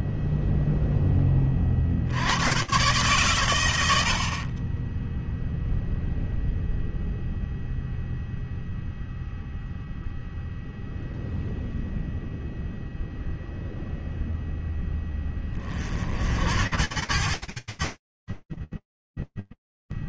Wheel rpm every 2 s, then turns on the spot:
0, 50, 90, 0, 0, 0, 0, 0, 50, 40.
none